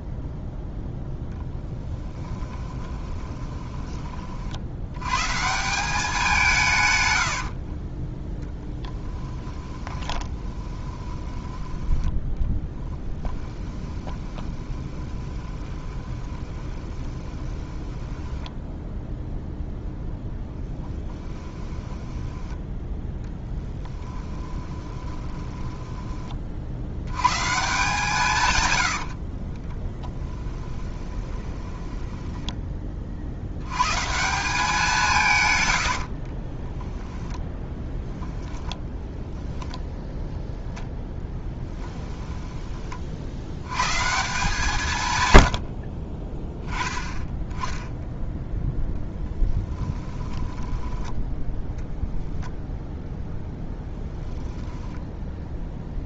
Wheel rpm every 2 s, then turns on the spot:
0, 10, 70, 150, 10, 20, 10, 20, 20, 10, 10, 10, 20, 60, 110, 20, 10, 180, 20, 10, 0, 20, 110, 10, 10, 10, 0, 10.
2-4 8-22 24-26 30-32 36-40 50-52